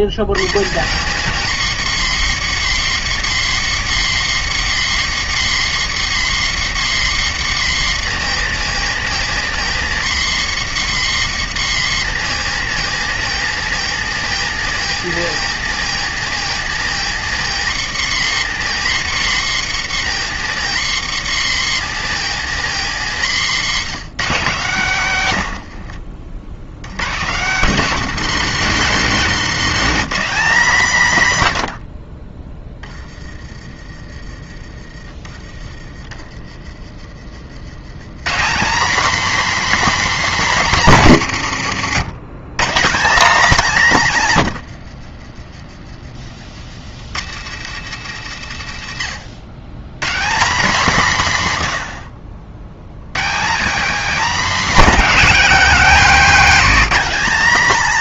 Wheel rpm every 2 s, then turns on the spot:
80, 190, 190, 180, 170, 180, 170, 170, 170, 180, 170, 160, 160, 90, 210, 210, 10, 30, 30, 210, 250, 170, 100, 70, 110, 190, 70, 240, 240.
44-46